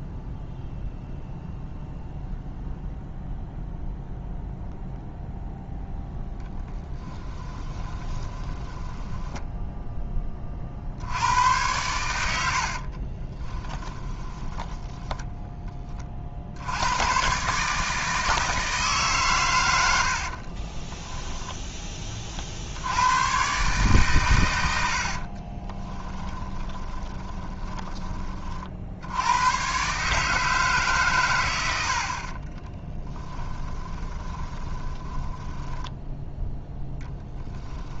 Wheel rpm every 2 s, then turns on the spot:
0, 0, 0, 10, 10, 70, 30, 10, 110, 140, 10, 100, 60, 30, 80, 130, 10, 10, 10.
6-10 12-16 20-22 24-28 32-38